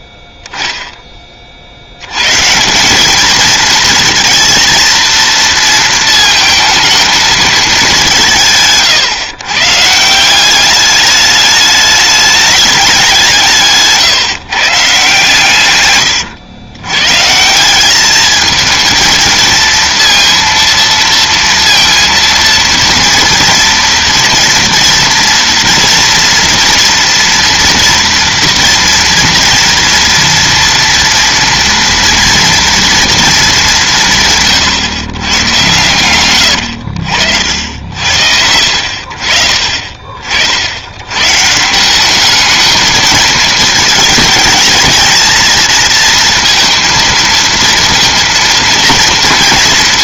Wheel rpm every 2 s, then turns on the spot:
0, 170, 220, 230, 150, 200, 200, 140, 120, 220, 230, 230, 230, 230, 240, 230, 230, 140, 90, 80, 70, 220, 220, 230, 230.
none